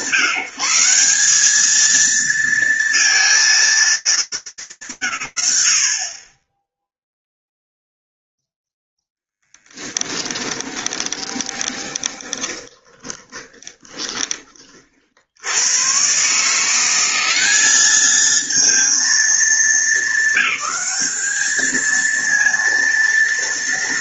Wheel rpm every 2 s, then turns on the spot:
170, 230, 180, 30, 0, 20, 20, 20, 160, 220, 220, 230.
10-14